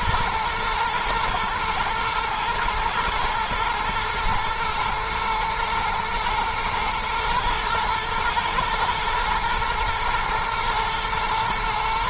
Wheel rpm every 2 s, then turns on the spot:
110, 110, 110, 110, 110, 110.
none